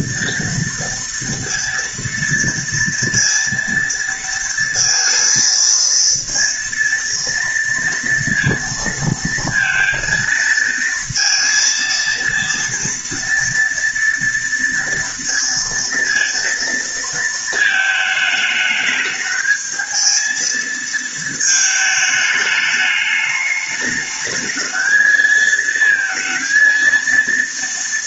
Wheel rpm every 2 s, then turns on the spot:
230, 230, 230, 230, 230, 230, 230, 230, 230, 220, 220, 210, 220, 230.
none